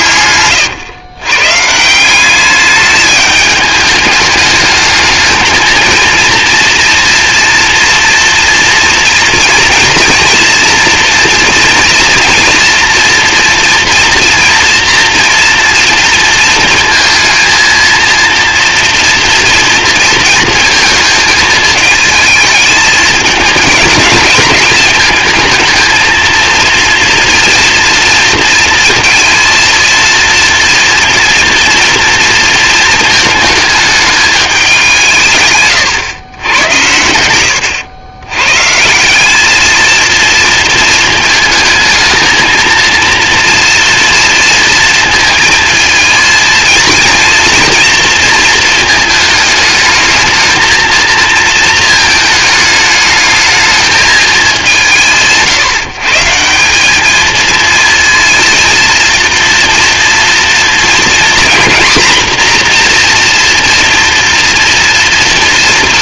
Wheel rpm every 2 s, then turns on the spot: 120, 210, 210, 230, 230, 240, 240, 230, 230, 240, 230, 220, 210, 230, 230, 230, 220, 190, 100, 150, 230, 230, 230, 230, 220, 230, 220, 180, 190, 230, 240, 250, 230.
none